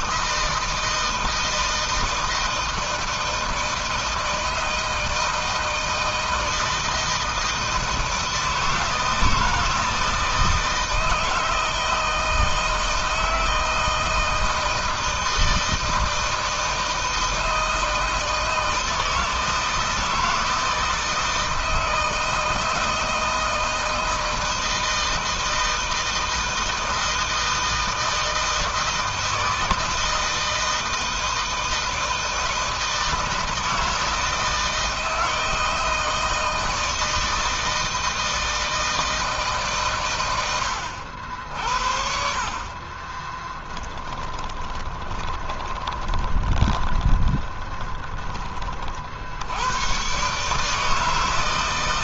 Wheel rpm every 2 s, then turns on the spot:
160, 160, 160, 160, 160, 160, 160, 160, 160, 160, 160, 160, 160, 160, 160, 160, 160, 160, 160, 160, 100, 40, 10, 20, 30, 150.
42-48